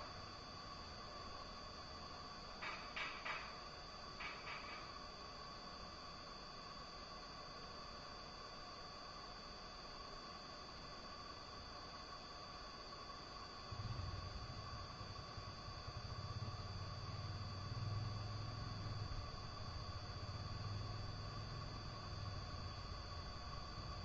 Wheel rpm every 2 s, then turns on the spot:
0, 0, 0, 0, 0, 0, 0, 0, 0, 0, 0, 0.
none